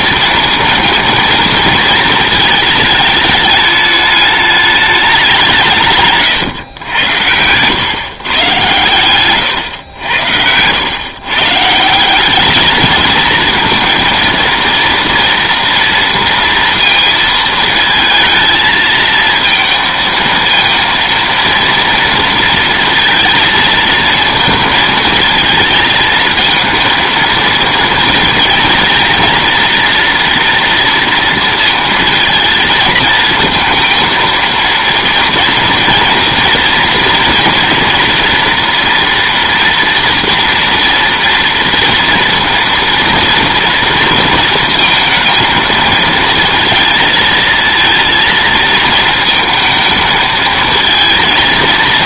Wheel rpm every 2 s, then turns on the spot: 230, 220, 210, 120, 120, 110, 210, 230, 230, 220, 230, 230, 230, 230, 230, 240, 220, 230, 230, 230, 230, 230, 230, 230, 220, 220.
8-10